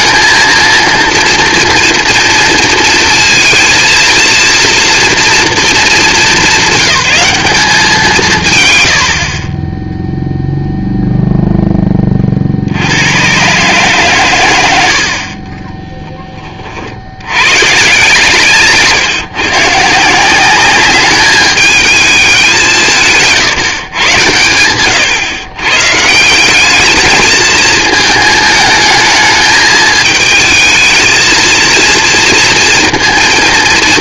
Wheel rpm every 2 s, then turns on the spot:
220, 230, 230, 200, 140, 0, 40, 110, 20, 150, 180, 200, 110, 180, 220, 220, 230.
none